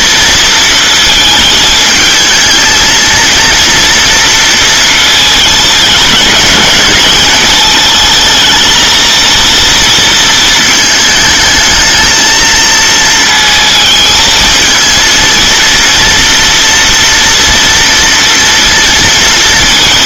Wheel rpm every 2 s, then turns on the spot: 220, 220, 220, 200, 230, 220, 220, 230, 230, 230.
none